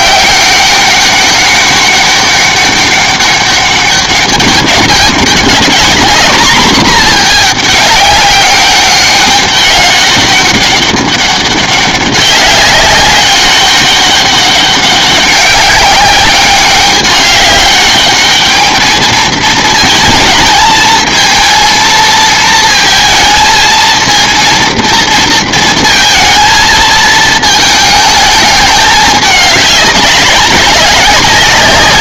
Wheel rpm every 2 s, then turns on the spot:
200, 200, 200, 230, 200, 200, 200, 200, 200, 210, 220, 230, 230, 230, 210, 190.
none